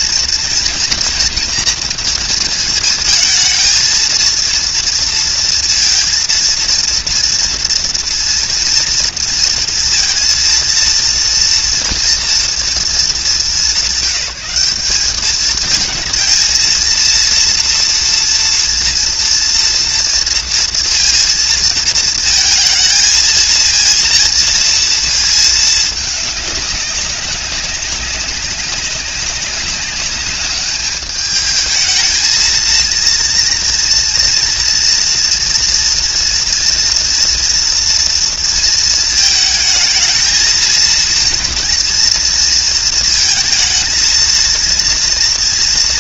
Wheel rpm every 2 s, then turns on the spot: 230, 230, 230, 230, 230, 230, 230, 200, 230, 230, 230, 230, 230, 210, 200, 210, 230, 240, 230, 230, 230, 230, 230.
none